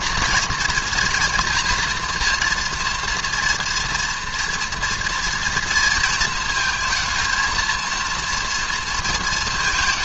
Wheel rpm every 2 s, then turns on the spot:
240, 230, 230, 220, 230.
none